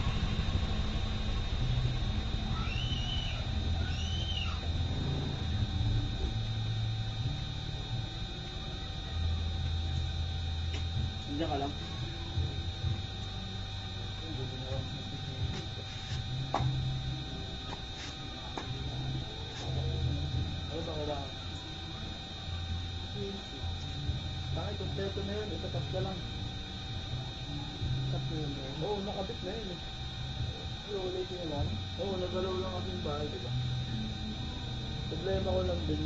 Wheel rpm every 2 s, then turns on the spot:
0, 0, 0, 0, 0, 0, 0, 0, 0, 0, 0, 0, 0, 0, 0, 0, 0, 0.
none